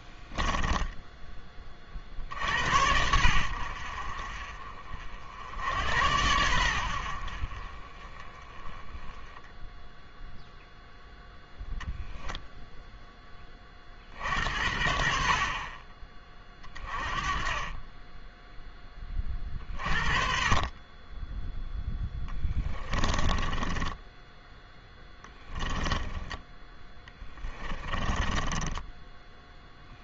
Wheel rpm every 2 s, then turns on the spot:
10, 80, 50, 80, 10, 0, 0, 60, 30, 10, 30, 20, 10, 10, 10.
0-2 22-30